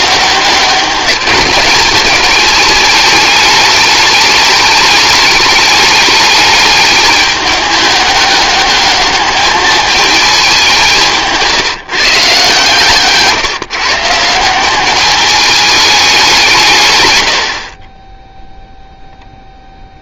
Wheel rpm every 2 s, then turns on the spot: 200, 210, 210, 210, 210, 190, 150, 190, 140, 0.
none